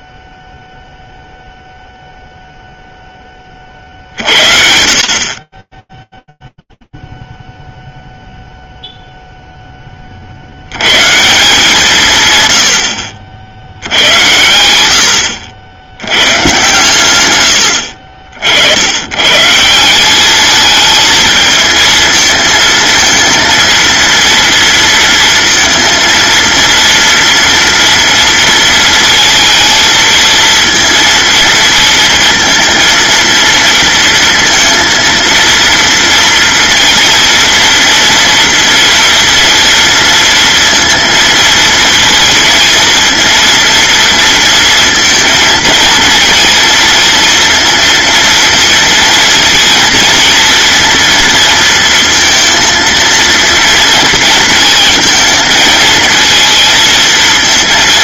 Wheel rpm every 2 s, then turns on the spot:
0, 40, 10, 0, 0, 90, 90, 80, 120, 90, 220, 220, 230, 230, 230, 230, 230, 230, 240, 230, 230, 230, 230, 230, 230, 230, 230, 230, 220.
none